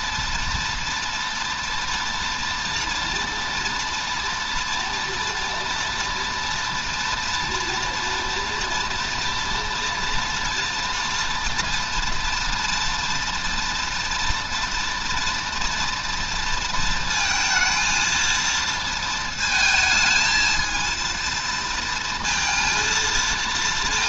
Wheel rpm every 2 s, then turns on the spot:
230, 240, 230, 230, 240, 240, 230, 230, 230, 230, 220, 230.
none